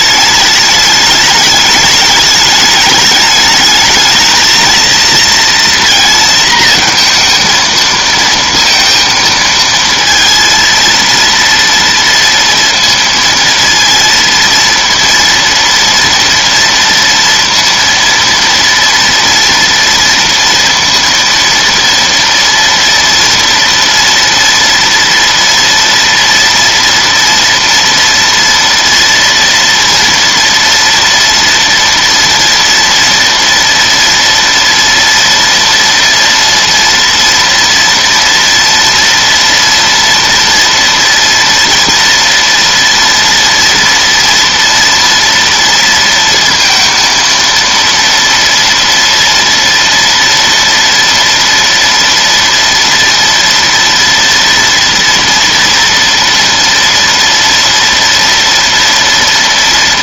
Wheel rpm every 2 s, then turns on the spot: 210, 210, 230, 230, 230, 230, 230, 230, 230, 230, 230, 240, 240, 230, 230, 230, 240, 240, 240, 230, 230, 230, 230, 230, 230, 230, 230, 230, 230, 230.
none